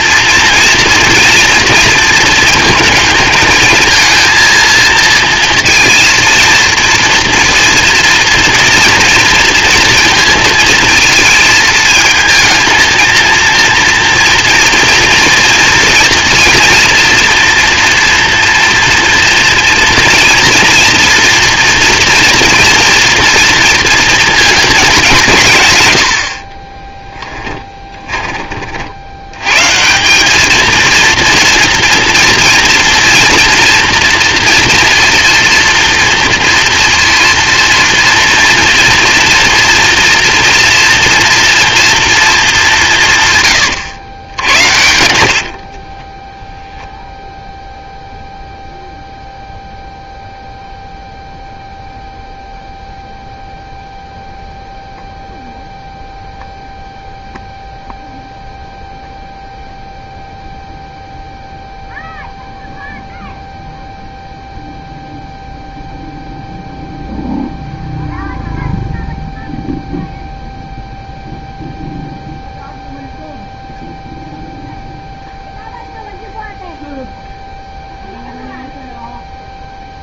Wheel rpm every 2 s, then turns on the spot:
240, 220, 230, 230, 230, 230, 230, 240, 240, 230, 230, 230, 210, 20, 60, 230, 240, 230, 230, 230, 240, 190, 90, 0, 0, 0, 0, 0, 0, 0, 0, 0, 0, 0, 0, 0, 0, 0, 0, 0.
26-28 44-46